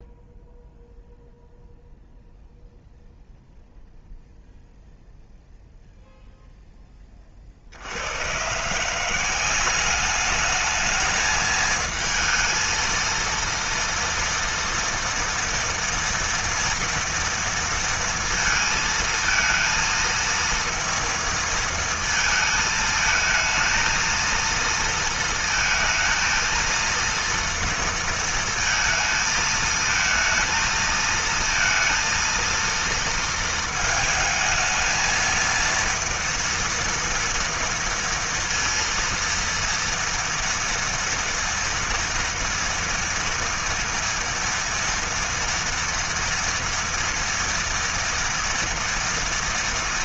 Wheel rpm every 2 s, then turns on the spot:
0, 0, 0, 10, 170, 220, 230, 230, 230, 230, 230, 220, 230, 230, 230, 230, 230, 220, 230, 230, 230, 230, 230, 230, 230.
none